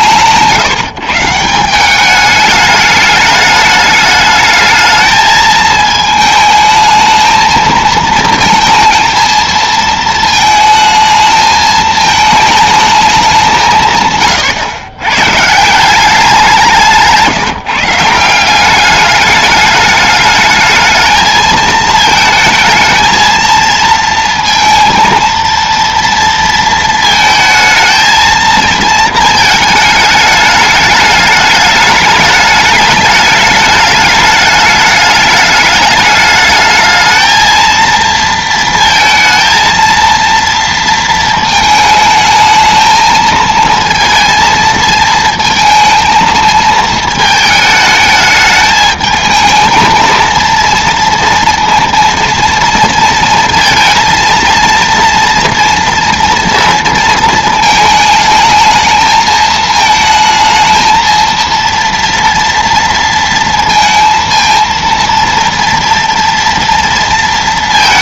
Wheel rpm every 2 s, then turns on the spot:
160, 210, 210, 220, 230, 220, 220, 120, 180, 190, 220, 220, 230, 230, 230, 210, 210, 210, 220, 230, 230, 220, 230, 220, 220, 230, 230, 230, 230, 220, 220, 230, 230, 230.
none